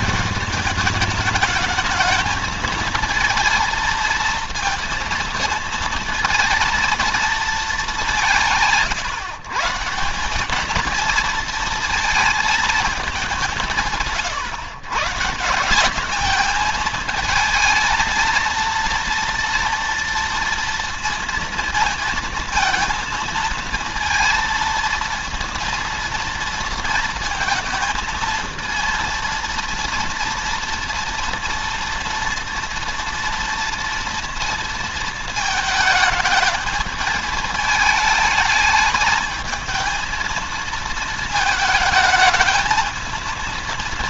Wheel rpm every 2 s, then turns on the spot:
210, 220, 230, 230, 160, 210, 210, 130, 220, 230, 230, 230, 230, 230, 230, 230, 230, 230, 220, 220, 220, 220.
none